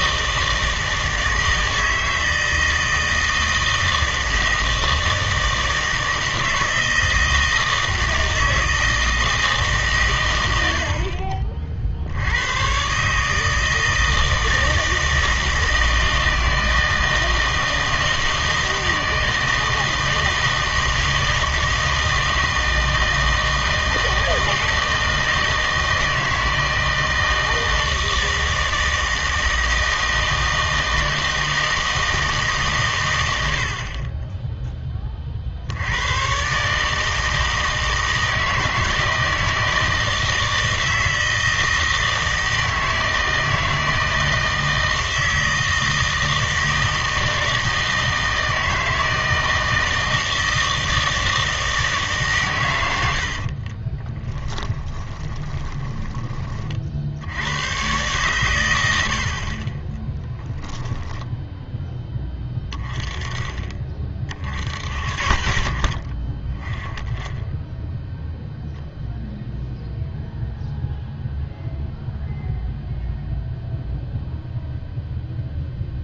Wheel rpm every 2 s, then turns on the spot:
160, 160, 160, 160, 160, 100, 110, 160, 160, 160, 160, 160, 160, 160, 160, 160, 140, 10, 140, 160, 160, 160, 160, 160, 160, 160, 120, 10, 30, 110, 10, 20, 50, 20, 0, 0, 0, 0.
54-56 60-62